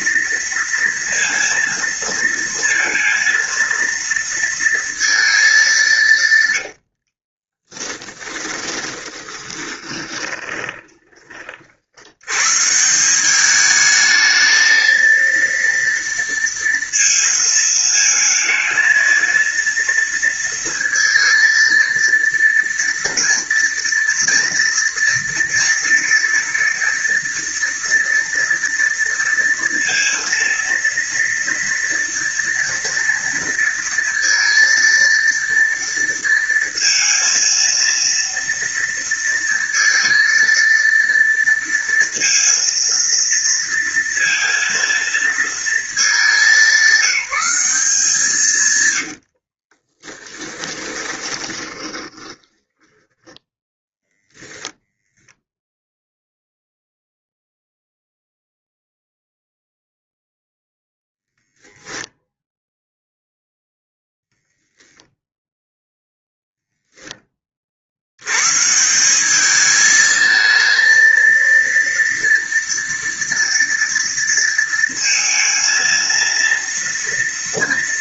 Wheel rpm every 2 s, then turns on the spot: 230, 230, 230, 130, 20, 20, 120, 220, 230, 230, 230, 230, 230, 230, 230, 230, 230, 230, 230, 230, 230, 230, 230, 190, 140, 10, 10, 0, 0, 0, 0, 0, 0, 0, 160, 230, 230, 230, 230.
6-12 50-54